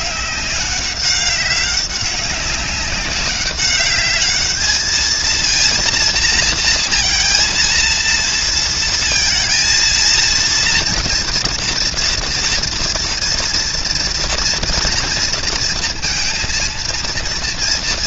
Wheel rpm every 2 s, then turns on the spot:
190, 200, 210, 230, 230, 230, 230, 230, 230.
none